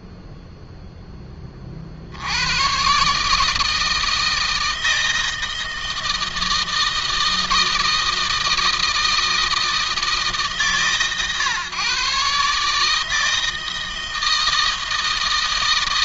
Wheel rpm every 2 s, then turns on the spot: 0, 110, 160, 160, 160, 140, 150, 160.
none